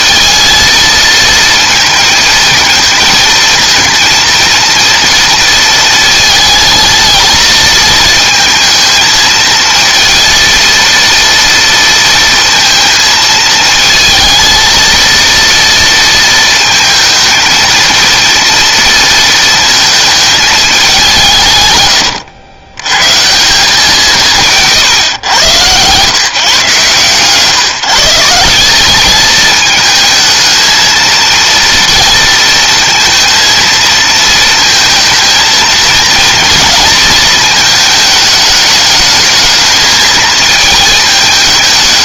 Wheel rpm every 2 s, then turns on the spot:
220, 220, 230, 230, 230, 230, 230, 220, 230, 230, 220, 110, 170, 140, 170, 220, 230, 220, 230, 220, 220.
none